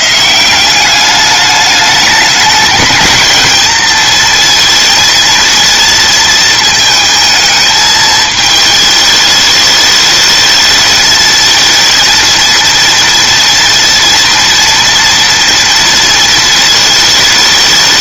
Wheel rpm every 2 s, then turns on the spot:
140, 210, 220, 230, 220, 210, 230, 230, 230.
none